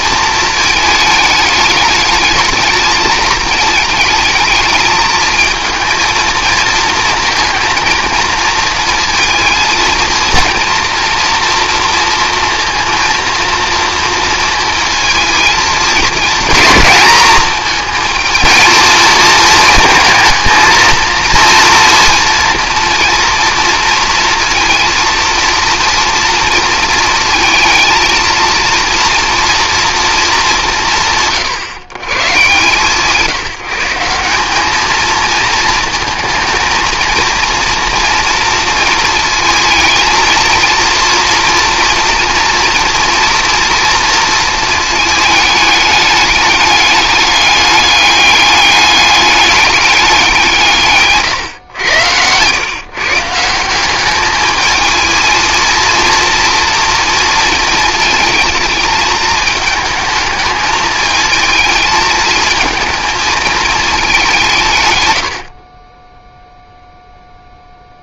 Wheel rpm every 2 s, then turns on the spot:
210, 220, 220, 230, 230, 230, 230, 230, 230, 230, 230, 240, 230, 230, 230, 120, 140, 220, 230, 230, 230, 230, 220, 210, 200, 140, 140, 220, 230, 220, 220, 220, 120, 0.
none